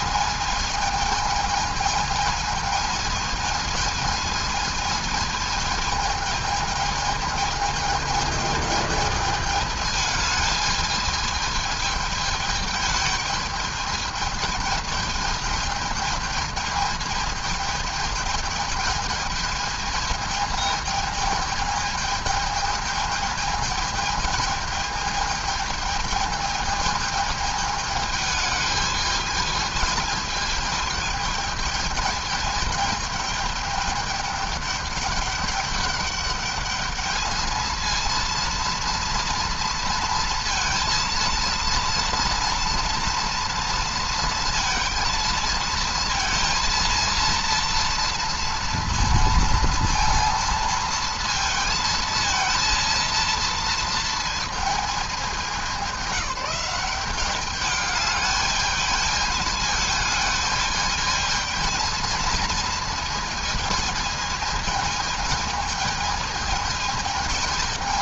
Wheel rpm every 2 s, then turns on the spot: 220, 220, 220, 220, 210, 210, 220, 220, 220, 210, 220, 220, 220, 220, 220, 220, 220, 210, 210, 230, 230, 230, 230, 230, 230, 230, 230, 220, 200, 210, 220, 230, 220, 220.
none